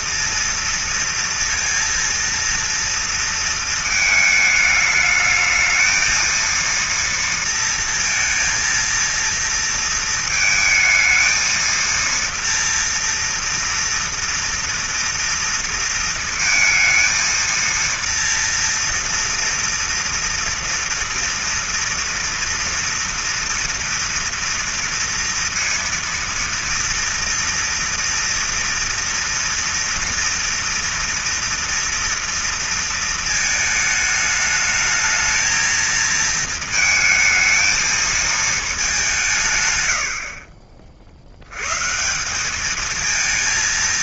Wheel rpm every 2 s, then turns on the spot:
230, 230, 220, 230, 230, 220, 230, 230, 230, 230, 230, 230, 230, 230, 230, 230, 230, 220, 220, 190, 50, 220.
none